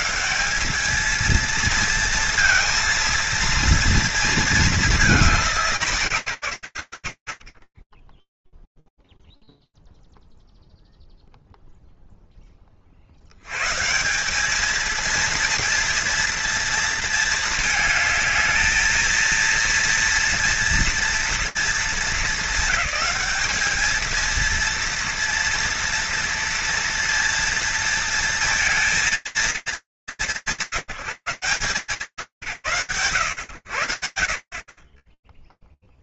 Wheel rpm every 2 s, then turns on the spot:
70, 230, 230, 180, 10, 0, 0, 160, 230, 220, 230, 210, 220, 230, 230, 200, 140, 50.
none